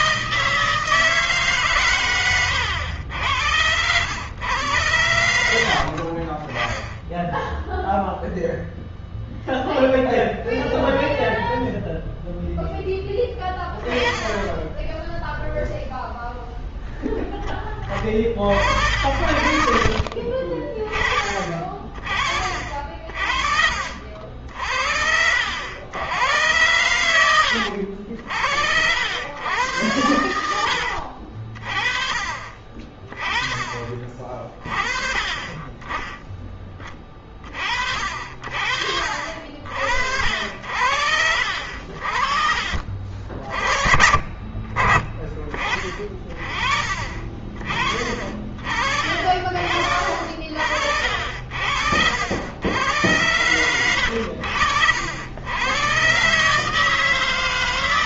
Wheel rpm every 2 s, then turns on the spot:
160, 100, 100, 40, 0, 0, 0, 10, 0, 40, 30, 40, 60, 90, 70, 90, 40, 40, 20, 60, 70, 50, 30, 40, 40, 60, 90, 80, 140.
none